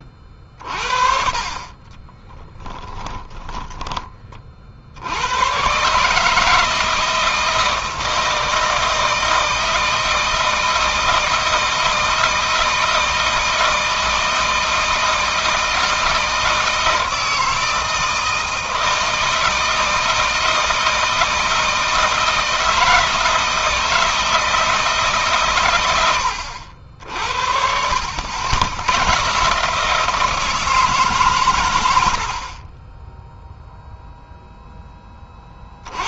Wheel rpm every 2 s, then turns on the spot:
40, 10, 80, 160, 160, 160, 160, 160, 160, 160, 160, 160, 150, 70, 100, 150, 20, 20.
2-4